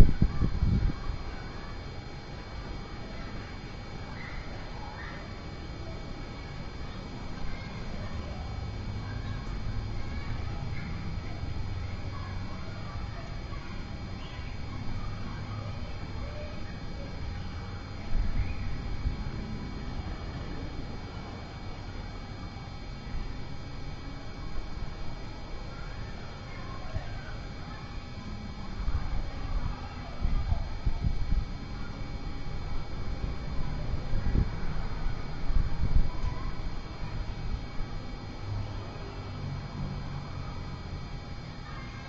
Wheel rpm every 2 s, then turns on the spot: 0, 0, 0, 0, 0, 0, 0, 0, 0, 0, 0, 0, 0, 0, 0, 0, 0, 0, 0, 0, 0.
none